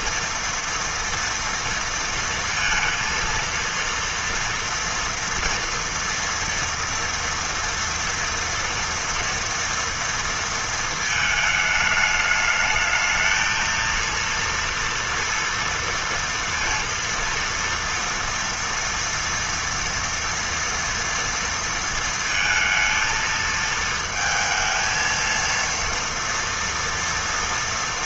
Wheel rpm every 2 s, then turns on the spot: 230, 230, 230, 240, 230, 230, 210, 230, 230, 230, 230, 230, 220, 230.
none